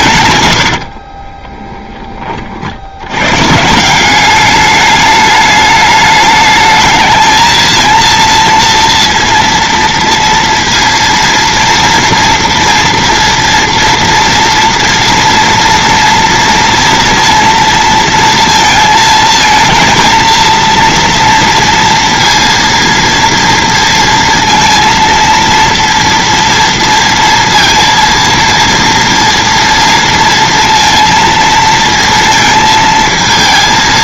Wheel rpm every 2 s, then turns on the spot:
90, 60, 200, 220, 230, 230, 230, 230, 230, 230, 230, 230, 230, 230, 230, 230, 220.
0-2